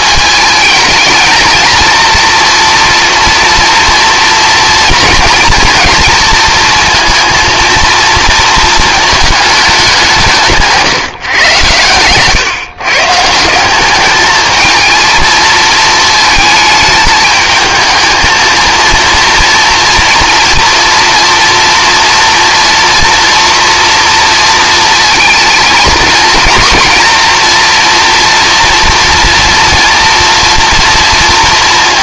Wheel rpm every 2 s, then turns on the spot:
220, 230, 230, 230, 220, 150, 140, 220, 220, 230, 230, 230, 230, 230, 230, 230.
10-12